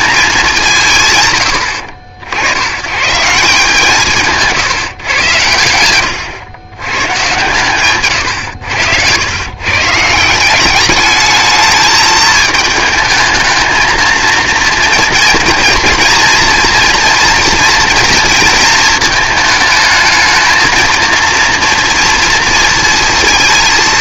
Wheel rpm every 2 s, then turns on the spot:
190, 90, 150, 110, 100, 190, 210, 230, 230, 230, 220, 230.
8-10